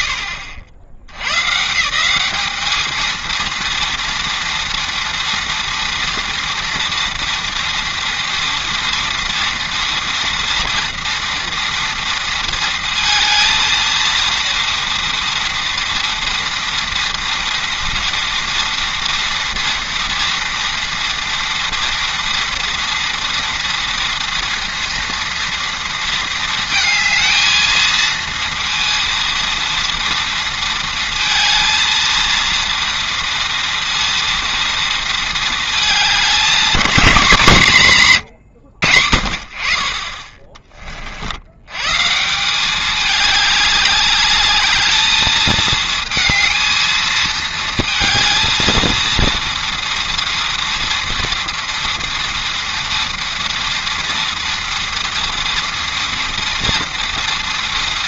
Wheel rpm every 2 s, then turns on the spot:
80, 230, 230, 230, 230, 230, 230, 230, 230, 230, 230, 230, 230, 220, 230, 230, 230, 220, 200, 50, 70, 210, 220, 220, 230, 230, 230, 230, 230.
none